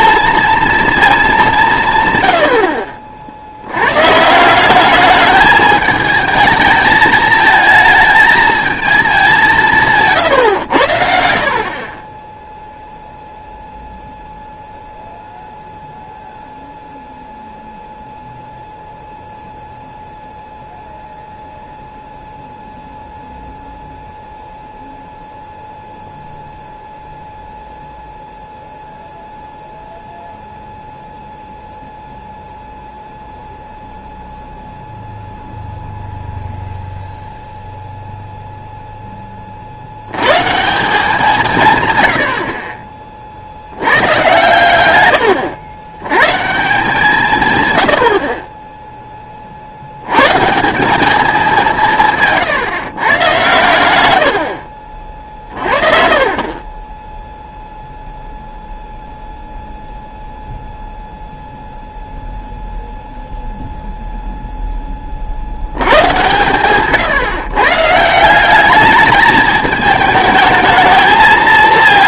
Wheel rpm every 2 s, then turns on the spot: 230, 60, 190, 220, 220, 100, 0, 0, 0, 0, 0, 0, 0, 0, 0, 0, 0, 0, 0, 0, 170, 40, 120, 160, 20, 170, 150, 60, 30, 0, 0, 0, 10, 140, 200, 220.
none